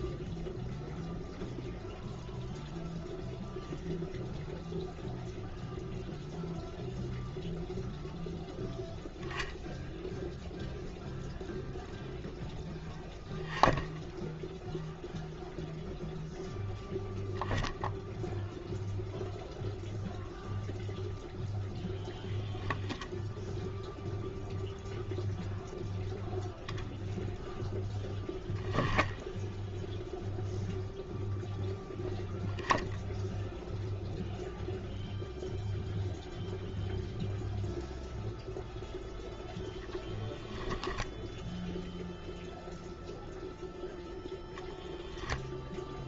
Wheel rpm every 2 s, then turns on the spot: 0, 0, 0, 0, 0, 0, 10, 0, 0, 0, 0, 0, 0, 10, 0, 0, 0, 0, 0, 0, 10, 0, 0.
40-42